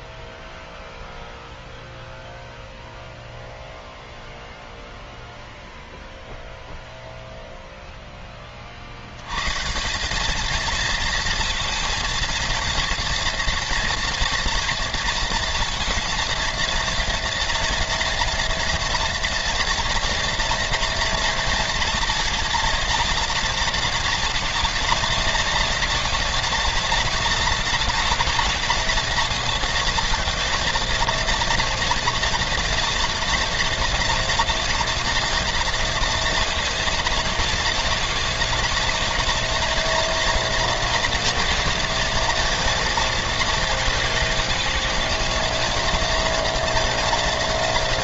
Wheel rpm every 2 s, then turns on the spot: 0, 0, 0, 0, 40, 220, 230, 230, 230, 230, 230, 230, 230, 230, 230, 230, 230, 230, 230, 230, 230, 230, 210, 230.
none